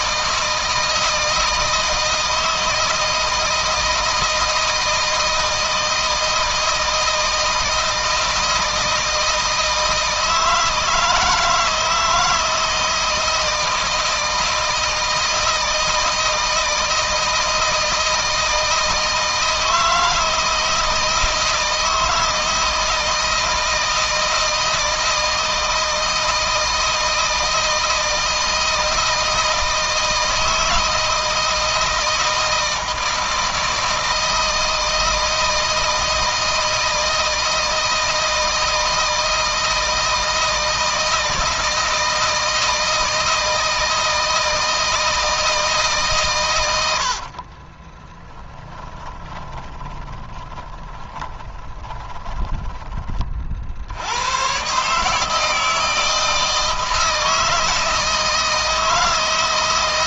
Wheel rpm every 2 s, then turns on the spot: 160, 160, 160, 160, 160, 160, 160, 160, 160, 160, 160, 160, 160, 160, 160, 160, 160, 160, 160, 160, 160, 160, 160, 100, 20, 20, 30, 140, 160, 160.
46-52